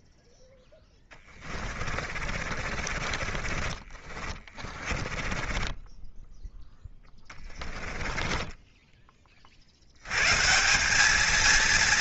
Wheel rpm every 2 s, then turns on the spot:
10, 40, 30, 10, 20, 220.
0-8